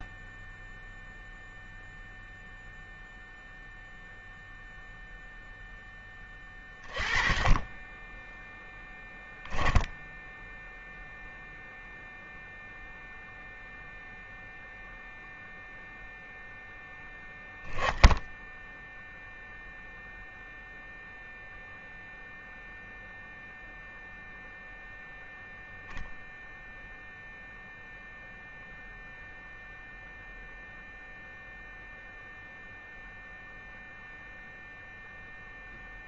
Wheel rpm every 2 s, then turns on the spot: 0, 0, 0, 20, 10, 0, 0, 0, 0, 0, 0, 0, 0, 0, 0, 0, 0, 0.
none